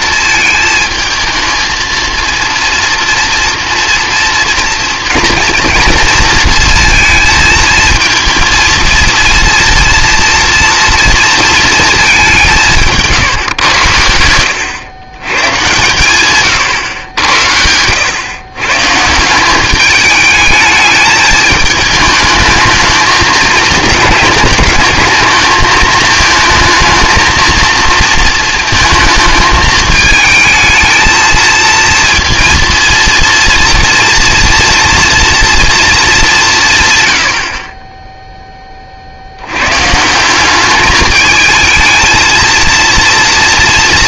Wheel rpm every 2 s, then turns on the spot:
220, 230, 240, 230, 230, 240, 170, 110, 120, 130, 210, 220, 210, 220, 230, 220, 230, 230, 160, 30, 200, 230.
none